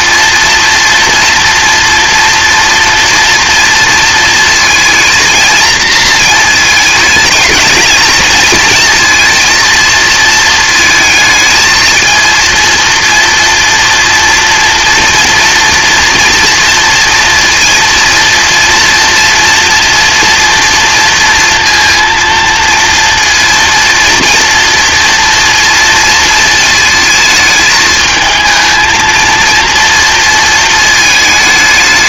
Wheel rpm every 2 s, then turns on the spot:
230, 240, 230, 220, 230, 220, 230, 230, 230, 230, 230, 230, 230, 220, 220, 230.
none